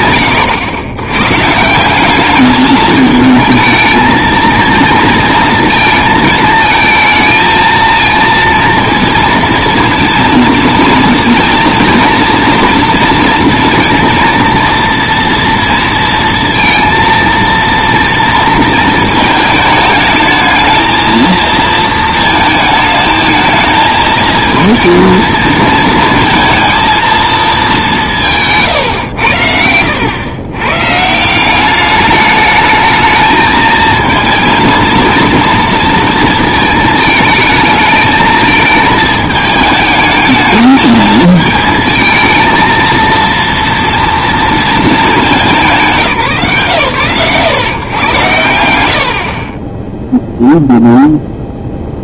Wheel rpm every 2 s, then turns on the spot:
110, 220, 230, 220, 230, 230, 230, 230, 230, 220, 230, 220, 230, 230, 100, 150, 220, 230, 220, 220, 220, 230, 230, 120, 60, 0.
none